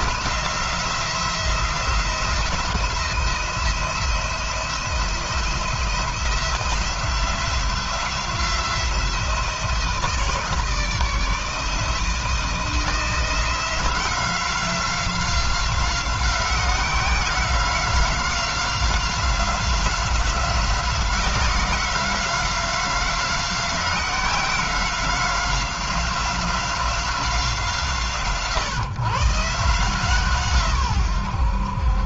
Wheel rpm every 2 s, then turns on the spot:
170, 170, 170, 170, 170, 160, 170, 180, 180, 180, 180, 180, 180, 180, 140, 130.
none